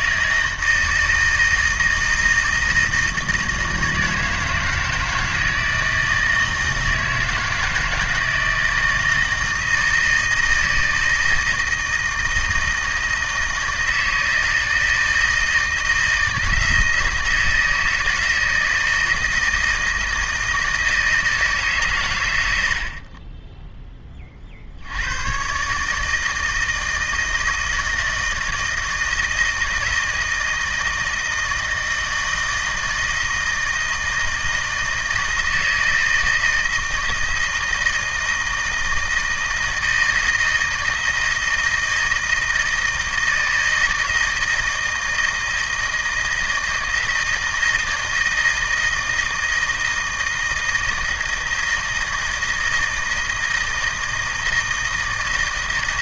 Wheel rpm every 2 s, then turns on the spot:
160, 160, 160, 160, 160, 160, 160, 160, 160, 160, 160, 70, 70, 160, 160, 160, 160, 160, 160, 160, 160, 160, 160, 160, 160, 160, 160, 160.
none